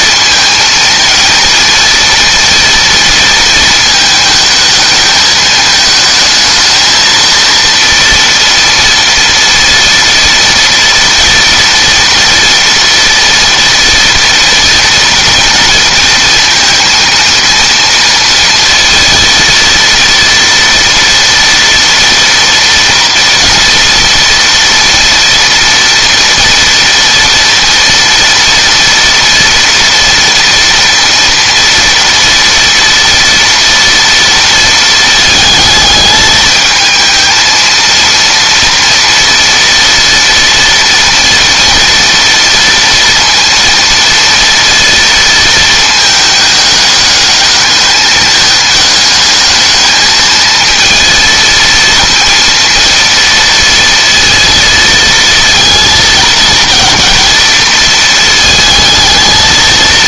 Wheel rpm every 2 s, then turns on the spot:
220, 230, 220, 220, 230, 230, 230, 230, 230, 230, 230, 230, 240, 230, 230, 240, 230, 220, 220, 230, 230, 230, 230, 210, 210, 230, 230, 230, 220, 220.
none